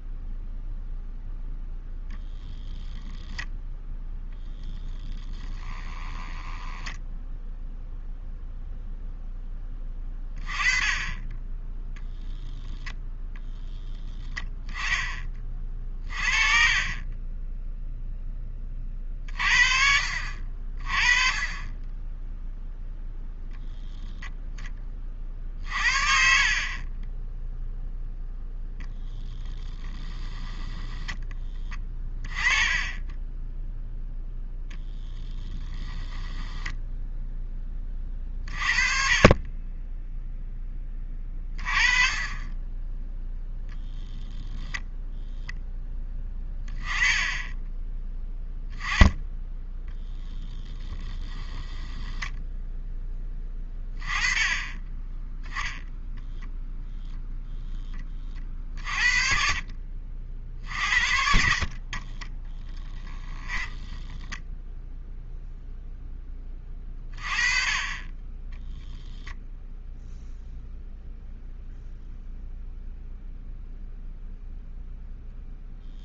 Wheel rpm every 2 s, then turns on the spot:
0, 0, 0, 0, 0, 20, 0, 10, 30, 30, 40, 0, 20, 30, 0, 10, 10, 0, 10, 40, 10, 10, 0, 20, 10, 10, 10, 20, 0, 50, 60, 10, 10, 30, 0, 0, 0, 0.
16-18 26-28 36-38 50-52 62-64